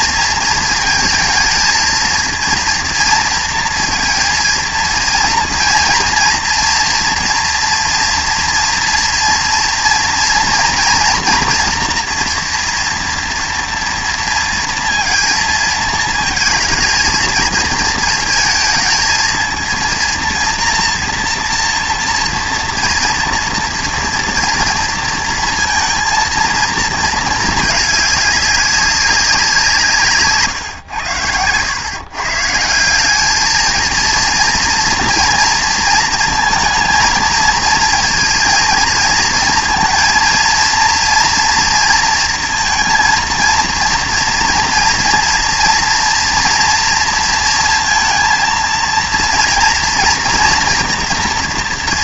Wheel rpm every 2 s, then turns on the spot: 230, 230, 230, 230, 230, 230, 240, 230, 220, 230, 230, 230, 230, 230, 200, 130, 170, 230, 230, 230, 230, 230, 230, 240, 230, 230.
none